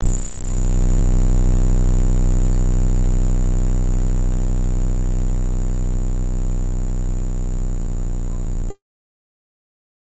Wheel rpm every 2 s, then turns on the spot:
0, 0, 0, 0, 0.
none